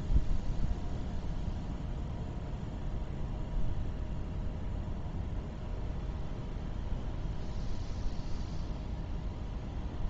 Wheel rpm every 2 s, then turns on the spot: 0, 0, 0, 0, 0.
none